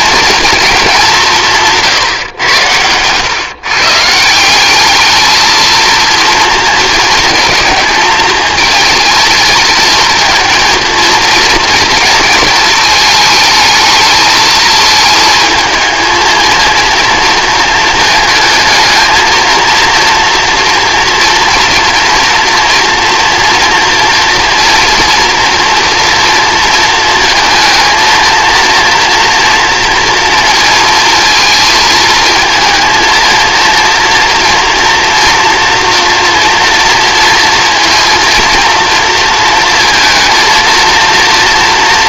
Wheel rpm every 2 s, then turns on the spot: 230, 120, 160, 230, 220, 230, 230, 220, 220, 220, 230, 230, 230, 230, 230, 230, 220, 230, 230, 230, 220.
none